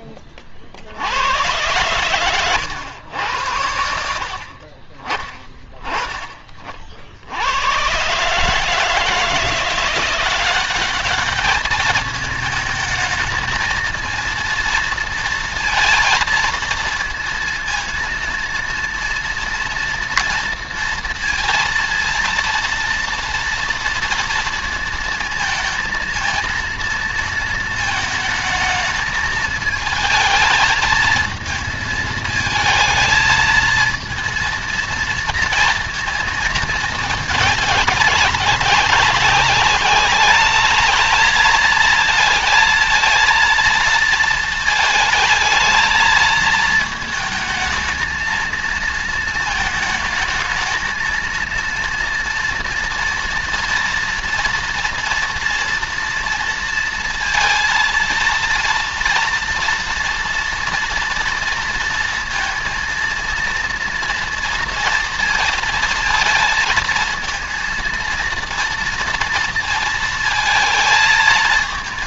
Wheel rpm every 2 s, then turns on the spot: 70, 110, 40, 50, 160, 200, 220, 230, 230, 230, 230, 230, 230, 230, 220, 220, 220, 230, 220, 190, 210, 220, 220, 220, 230, 220, 230, 240, 230, 230, 230, 230, 230, 230, 230, 220.
none